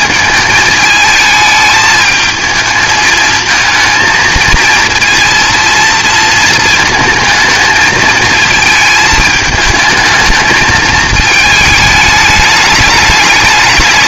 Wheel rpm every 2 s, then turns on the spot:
220, 220, 230, 220, 220, 220, 210.
none